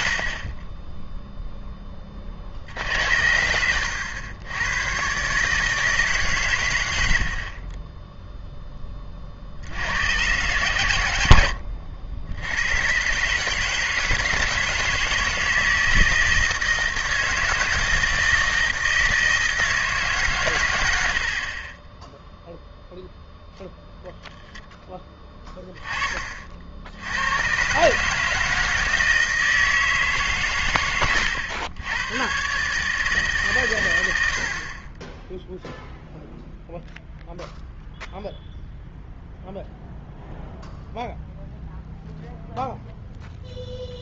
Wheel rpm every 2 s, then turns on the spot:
10, 70, 110, 100, 20, 110, 120, 160, 160, 160, 90, 0, 10, 70, 160, 110, 140, 30, 0, 0, 0, 0.
none